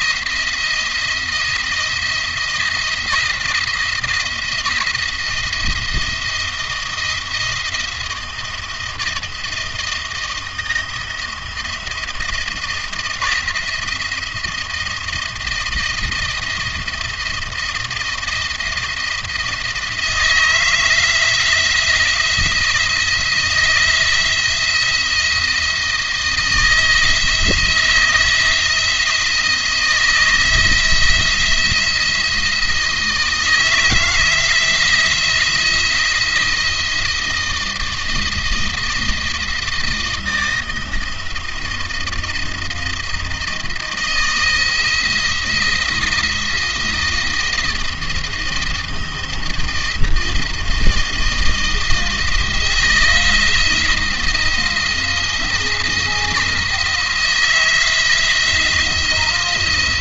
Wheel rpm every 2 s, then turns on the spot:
170, 170, 160, 170, 170, 160, 170, 170, 170, 170, 160, 170, 160, 160, 170, 160, 160, 170, 160, 160, 160, 170, 170, 170, 160, 160, 160, 170, 170, 170.
none